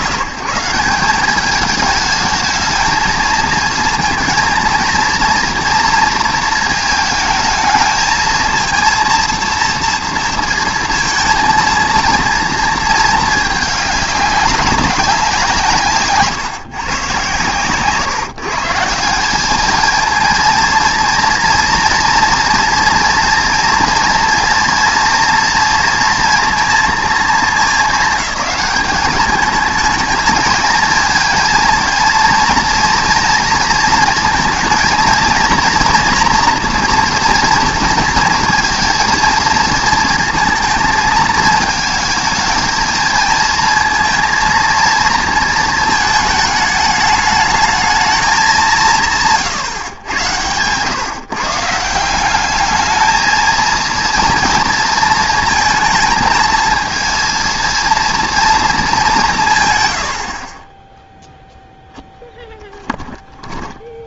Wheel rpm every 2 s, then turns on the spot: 170, 220, 220, 220, 220, 230, 230, 200, 140, 150, 230, 230, 230, 230, 200, 220, 230, 230, 230, 230, 230, 230, 230, 210, 200, 110, 200, 230, 230, 230, 30, 10.
62-64